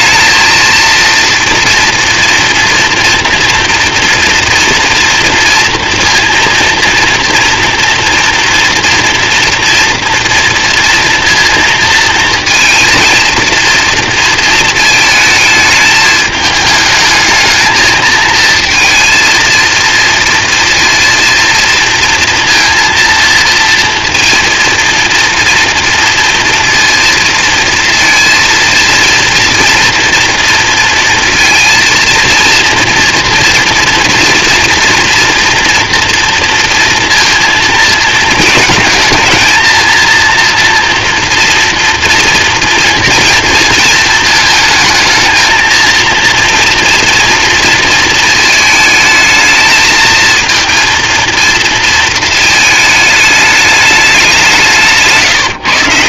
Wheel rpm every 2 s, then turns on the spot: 230, 230, 230, 230, 240, 230, 220, 230, 210, 230, 230, 230, 230, 230, 230, 230, 230, 240, 230, 220, 230, 230, 220, 230, 220, 230, 220, 180.
none